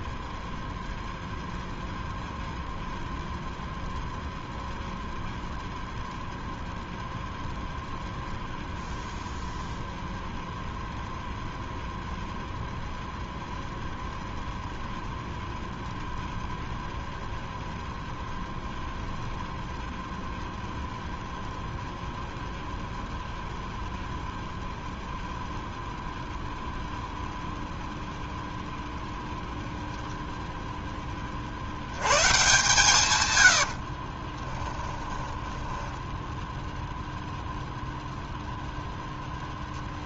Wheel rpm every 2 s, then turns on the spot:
0, 0, 0, 0, 0, 0, 0, 0, 0, 0, 0, 0, 0, 0, 0, 0, 130, 10, 0, 0.
34-36